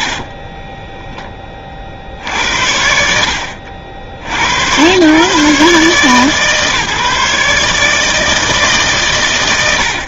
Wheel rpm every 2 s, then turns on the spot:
40, 60, 150, 150, 120.
none